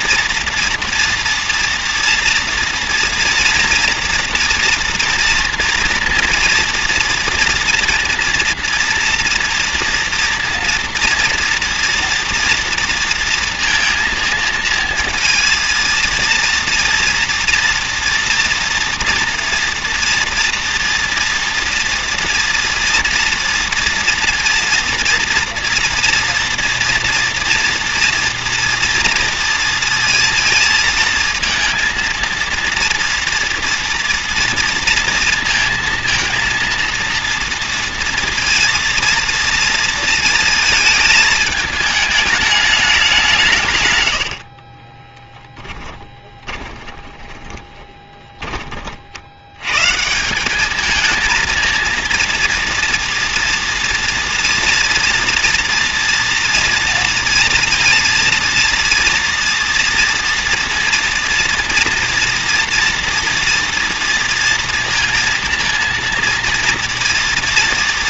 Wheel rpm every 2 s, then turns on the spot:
230, 230, 240, 230, 230, 240, 230, 230, 240, 230, 230, 230, 230, 240, 230, 230, 230, 230, 230, 230, 220, 210, 50, 20, 20, 200, 230, 230, 230, 230, 230, 230, 230, 230.
44-48